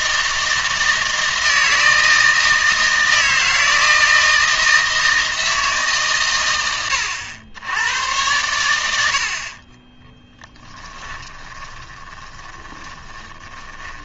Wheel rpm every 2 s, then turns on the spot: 160, 160, 160, 100, 90, 20, 20.
10-14